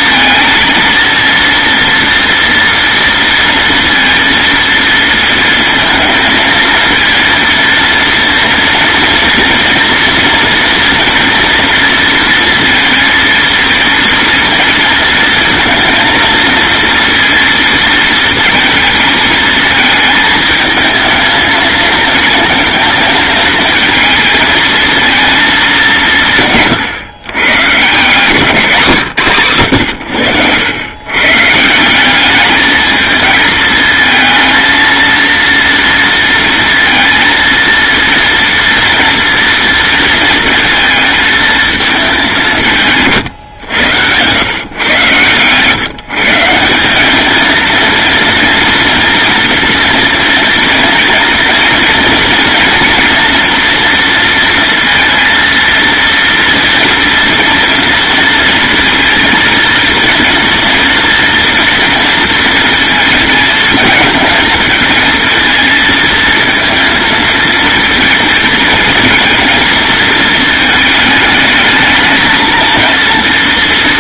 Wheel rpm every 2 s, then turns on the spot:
230, 230, 230, 230, 240, 240, 230, 230, 230, 220, 220, 230, 220, 150, 140, 110, 220, 230, 230, 230, 230, 150, 130, 190, 230, 230, 230, 230, 230, 230, 240, 230, 220, 230, 230, 220, 230.
none